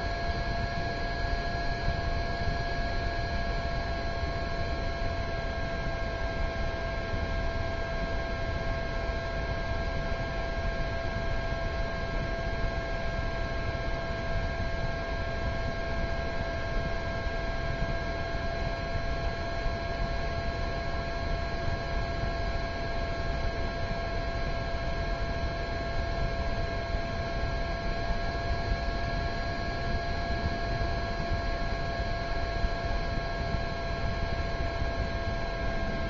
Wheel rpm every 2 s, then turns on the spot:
0, 0, 0, 0, 0, 0, 0, 0, 0, 0, 0, 0, 0, 0, 0, 0, 0, 0.
none